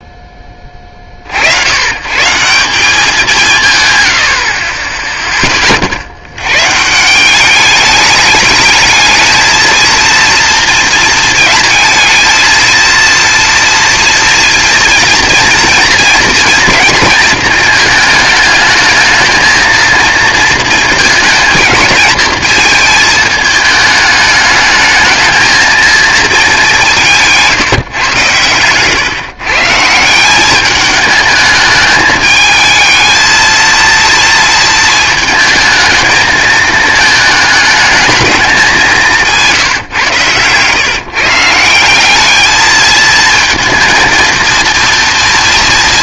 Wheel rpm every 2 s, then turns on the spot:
30, 180, 10, 140, 220, 230, 230, 240, 230, 220, 230, 230, 220, 190, 120, 210, 220, 230, 220, 190, 130, 220, 230.
28-30